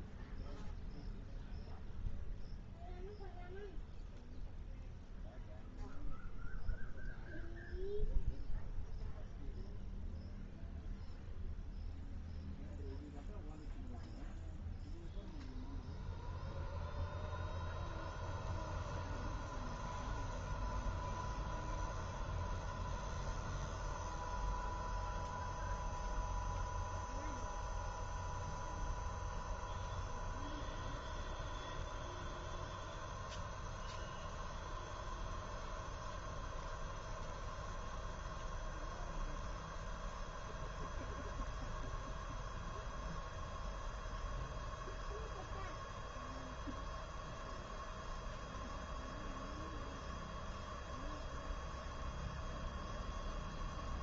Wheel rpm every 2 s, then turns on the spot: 0, 0, 0, 0, 0, 0, 0, 0, 0, 0, 0, 0, 0, 0, 0, 0, 0, 0, 0, 0, 0, 0, 0, 0, 0, 0, 0.
none